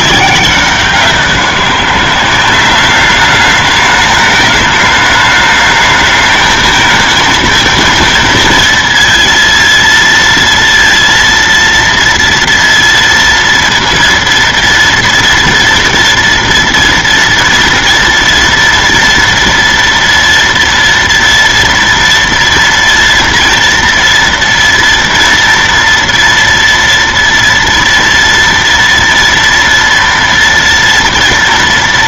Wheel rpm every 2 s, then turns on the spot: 190, 200, 210, 220, 230, 230, 230, 230, 230, 230, 230, 230, 230, 230, 230, 230.
none